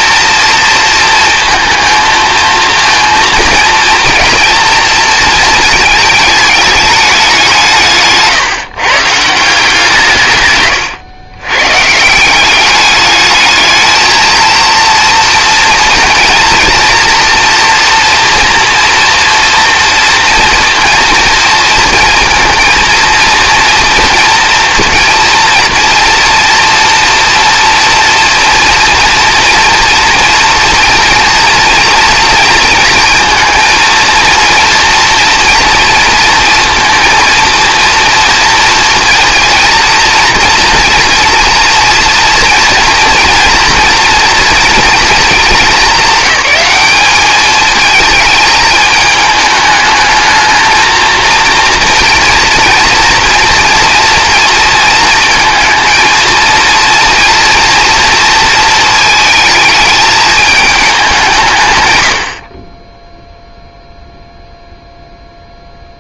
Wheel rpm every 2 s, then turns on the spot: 220, 230, 230, 210, 150, 130, 200, 230, 230, 230, 230, 230, 230, 230, 230, 230, 230, 230, 230, 230, 230, 230, 230, 200, 220, 230, 230, 230, 230, 220, 200, 20, 0.
none